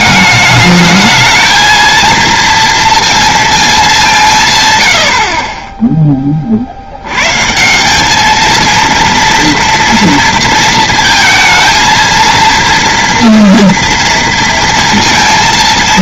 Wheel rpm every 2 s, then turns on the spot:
210, 230, 130, 40, 220, 230, 230, 230.
none